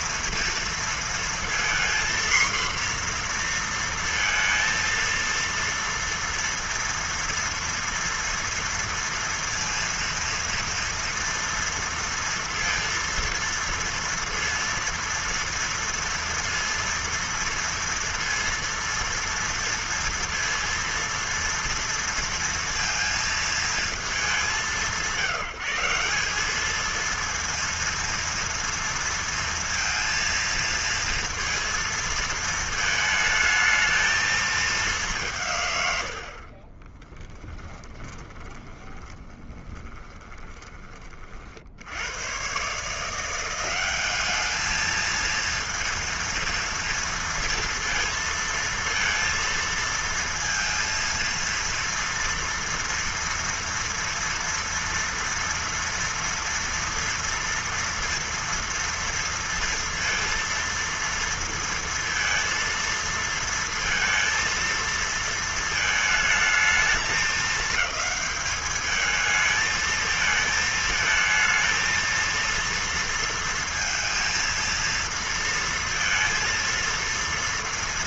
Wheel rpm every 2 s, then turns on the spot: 230, 250, 230, 230, 230, 230, 230, 230, 230, 230, 230, 230, 190, 210, 230, 230, 220, 210, 40, 20, 20, 130, 210, 230, 230, 230, 230, 230, 230, 230, 230, 230, 230, 220, 210, 220, 230, 230, 230.
36-42